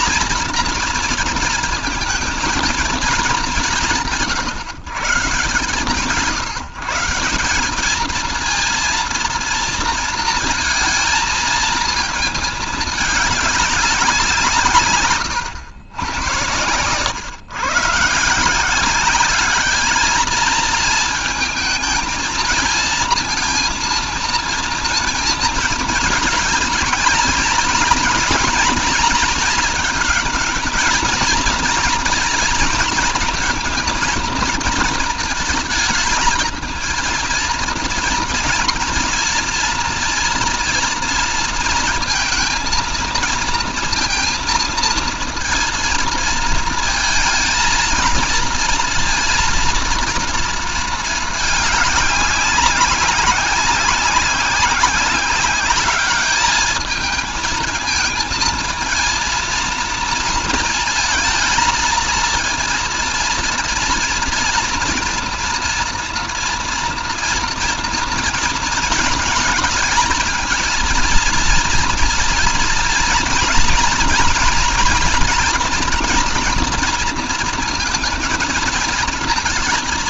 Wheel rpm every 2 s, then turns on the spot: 230, 220, 140, 150, 230, 230, 220, 140, 120, 190, 220, 230, 230, 230, 230, 220, 220, 230, 230, 230, 230, 230, 230, 220, 230, 220, 190, 190, 220, 230, 220, 230, 230, 240, 220, 230, 240, 230, 230, 230.
none